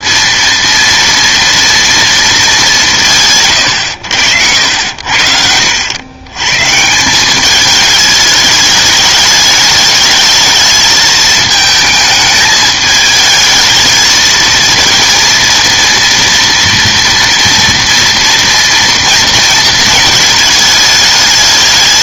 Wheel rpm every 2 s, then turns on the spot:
230, 200, 100, 140, 210, 220, 210, 230, 240, 230, 220.
none